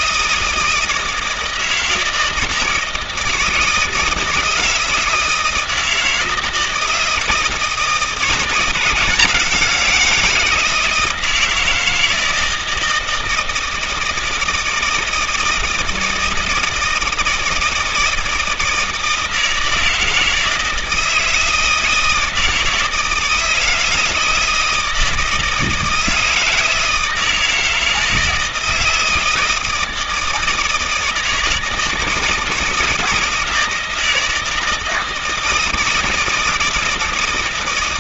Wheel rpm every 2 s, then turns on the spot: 160, 160, 160, 160, 170, 170, 160, 160, 160, 160, 160, 160, 160, 160, 160, 160, 160, 160, 160.
none